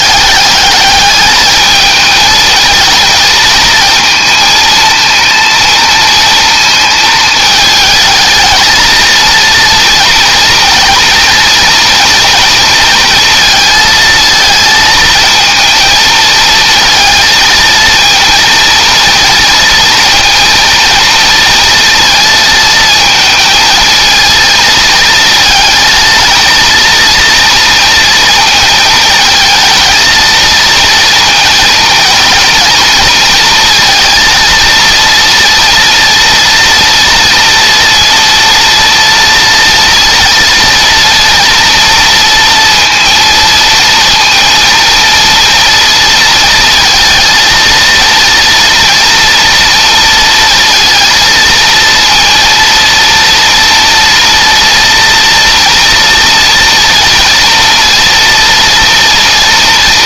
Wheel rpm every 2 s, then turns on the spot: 210, 220, 230, 220, 220, 230, 220, 230, 230, 230, 230, 220, 230, 230, 220, 230, 230, 230, 230, 230, 230, 230, 230, 230, 230, 230, 230, 230, 230, 230.
none